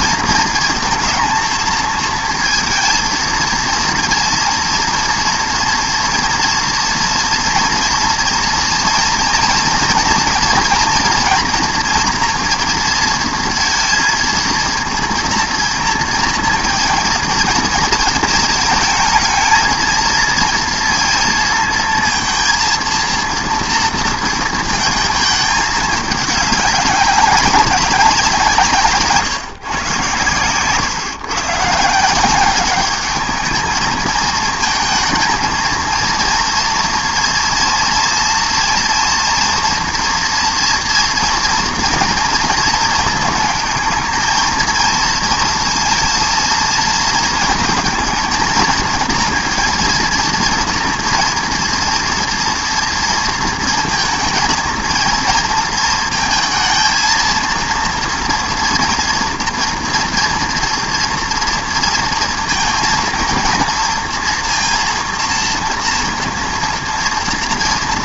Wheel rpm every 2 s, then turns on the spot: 230, 230, 230, 230, 230, 230, 230, 230, 230, 220, 230, 230, 230, 200, 170, 120, 190, 220, 230, 240, 230, 230, 220, 230, 220, 230, 230, 230, 220, 230, 230, 230, 230, 230.
30-32